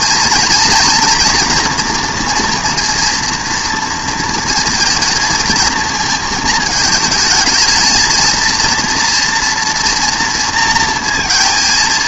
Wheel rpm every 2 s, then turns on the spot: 240, 230, 230, 220, 230, 230.
none